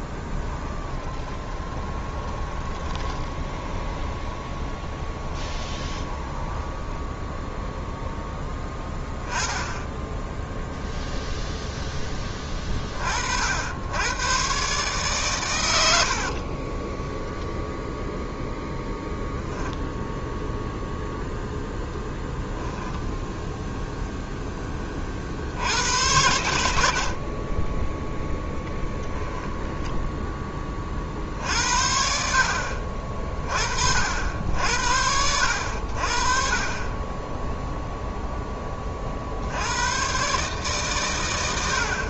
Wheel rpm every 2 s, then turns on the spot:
20, 20, 20, 10, 10, 0, 30, 130, 20, 0, 0, 0, 20, 80, 0, 20, 60, 70, 30, 10, 140.
0-8 16-18